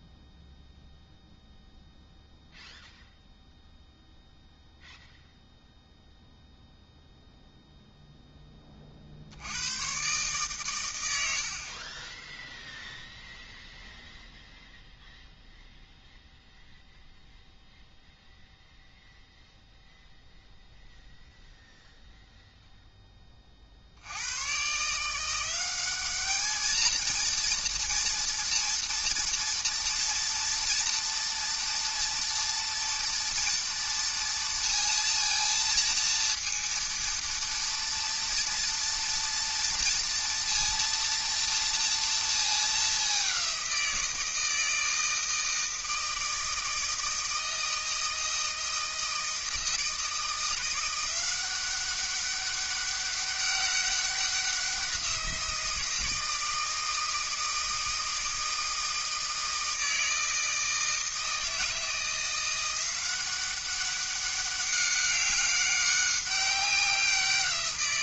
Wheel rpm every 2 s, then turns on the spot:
0, 0, 0, 0, 30, 120, 0, 0, 0, 0, 0, 0, 130, 220, 230, 230, 230, 230, 230, 230, 230, 210, 160, 160, 160, 170, 200, 190, 160, 160, 160, 180, 200, 190.
none